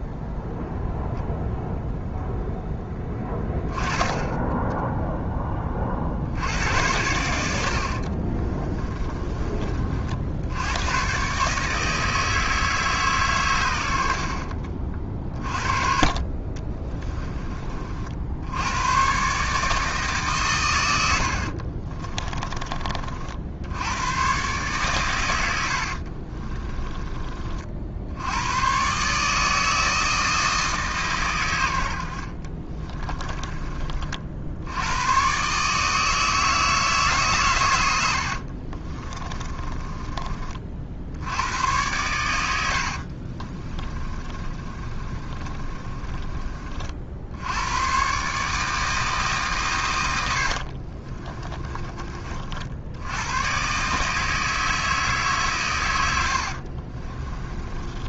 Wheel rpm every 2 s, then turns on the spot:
0, 10, 0, 90, 20, 110, 150, 40, 30, 110, 100, 40, 130, 20, 130, 140, 30, 90, 150, 40, 60, 60, 30, 40, 160, 50, 80, 160, 40.
8-10 16-18 26-28 32-34 38-40 42-46 50-52 56-58